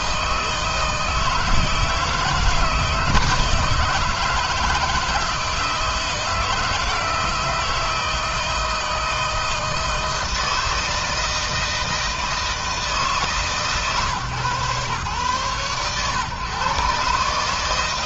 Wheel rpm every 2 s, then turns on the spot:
160, 160, 160, 160, 160, 160, 150, 130, 140.
none